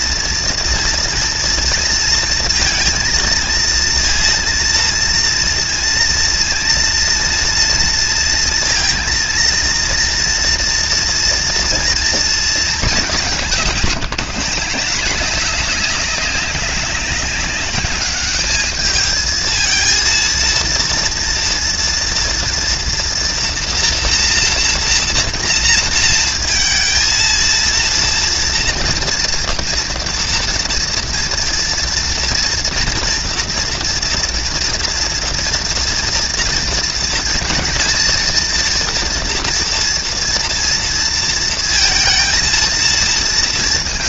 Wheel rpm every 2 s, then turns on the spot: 230, 230, 230, 230, 230, 240, 220, 180, 200, 210, 230, 230, 240, 230, 240, 230, 230, 240, 230, 230, 230, 220.
none